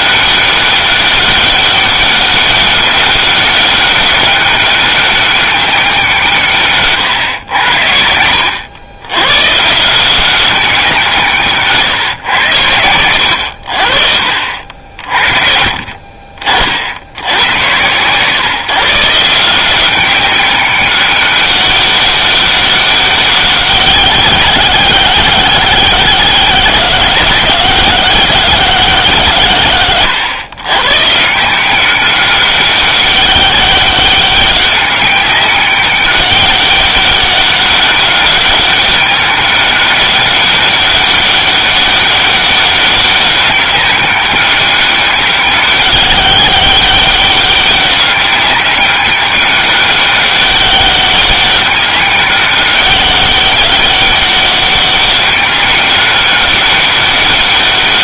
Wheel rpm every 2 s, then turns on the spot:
200, 190, 200, 150, 90, 180, 100, 60, 40, 140, 190, 200, 190, 180, 180, 130, 200, 200, 200, 200, 200, 200, 190, 200, 200, 200, 200, 200, 200.
none